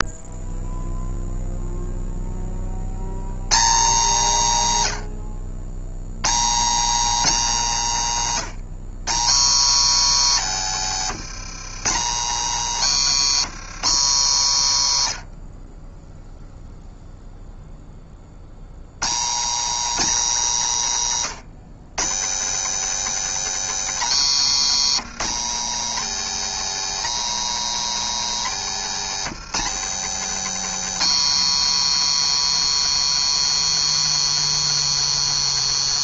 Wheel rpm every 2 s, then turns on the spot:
0, 90, 90, 210, 180, 180, 210, 100, 0, 140, 150, 240, 230, 250, 220, 250, 250, 250.
10-14